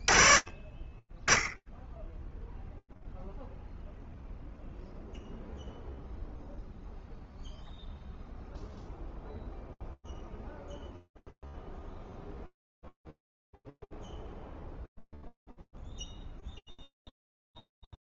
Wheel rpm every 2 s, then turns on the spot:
10, 0, 0, 0, 0, 0, 50, 50, 0.
none